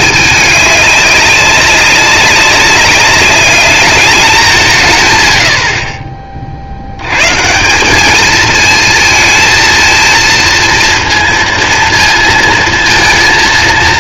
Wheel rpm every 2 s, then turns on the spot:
200, 200, 130, 80, 220, 230, 230.
none